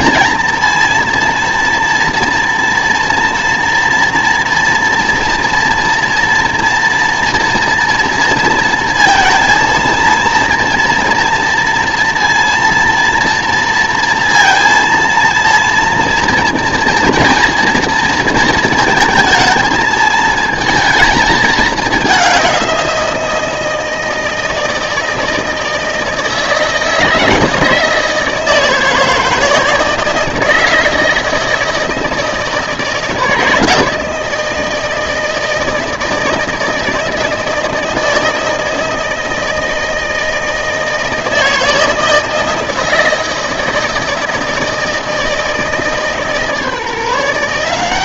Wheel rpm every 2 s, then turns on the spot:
230, 230, 230, 240, 230, 230, 230, 230, 240, 230, 220, 190, 160, 160, 160, 160, 160, 160, 160, 160, 160, 160, 160, 150.
none